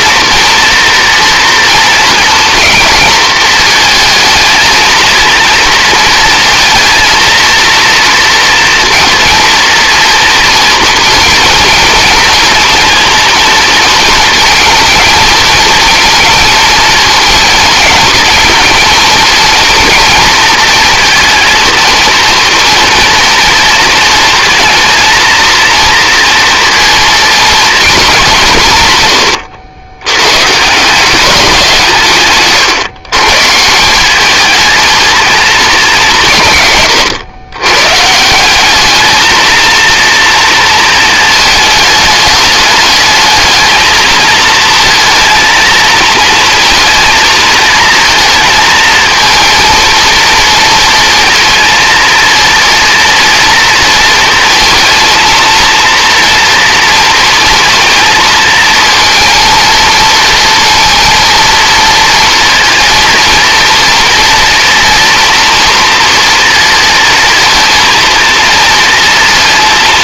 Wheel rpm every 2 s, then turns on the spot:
230, 220, 230, 230, 230, 230, 230, 220, 220, 230, 230, 230, 230, 230, 140, 150, 140, 220, 100, 200, 230, 210, 230, 230, 220, 230, 230, 230, 220, 220, 230, 240, 230, 230, 230.
none